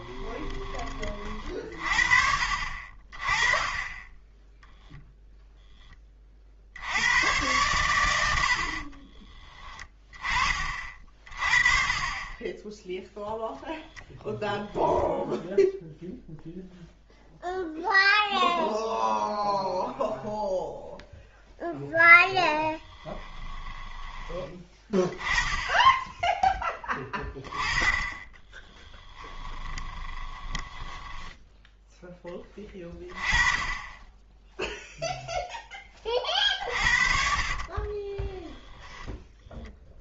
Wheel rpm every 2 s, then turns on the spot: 40, 40, 0, 70, 50, 40, 0, 0, 0, 0, 0, 20, 10, 10, 20, 10, 20, 0, 50, 20.
8-10 22-24 28-32 36-40